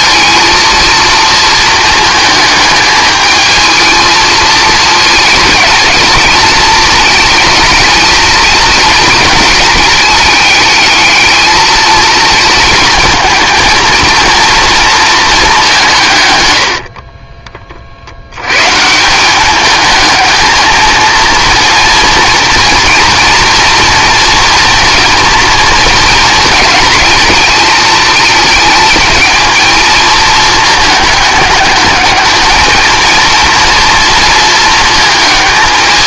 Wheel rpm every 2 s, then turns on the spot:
230, 220, 220, 220, 230, 210, 230, 230, 90, 130, 220, 230, 240, 220, 220, 220, 220, 230.
16-18